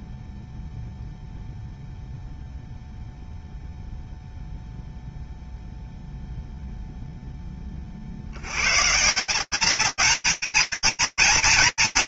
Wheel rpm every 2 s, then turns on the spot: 0, 0, 0, 40, 210, 230.
none